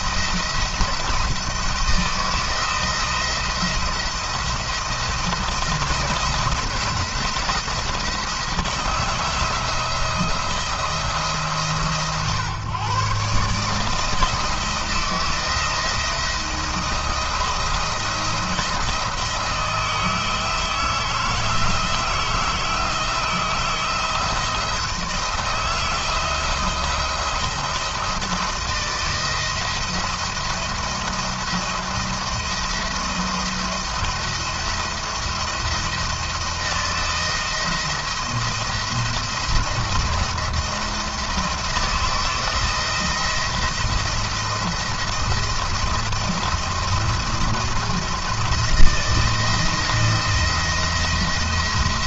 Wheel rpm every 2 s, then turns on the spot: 170, 170, 160, 170, 160, 170, 130, 160, 170, 170, 160, 160, 170, 170, 160, 160, 170, 170, 170, 170, 170, 170, 170, 170, 170, 170.
none